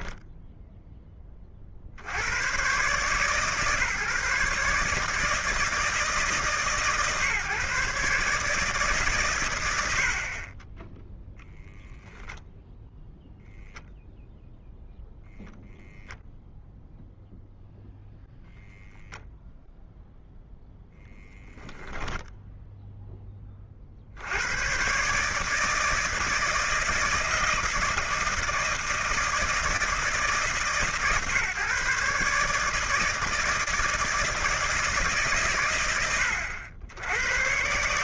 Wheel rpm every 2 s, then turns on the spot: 10, 130, 150, 130, 150, 20, 0, 0, 0, 0, 0, 0, 120, 170, 160, 140, 150, 160, 80.
none